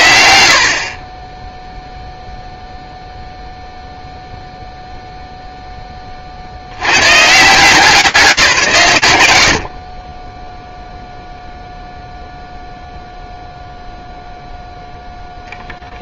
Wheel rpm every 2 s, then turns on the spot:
30, 0, 0, 80, 120, 0, 0, 0.
none